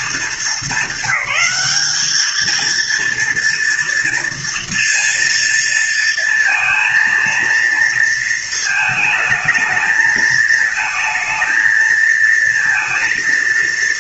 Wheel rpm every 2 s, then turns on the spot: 220, 230, 230, 230, 220, 220, 230.
none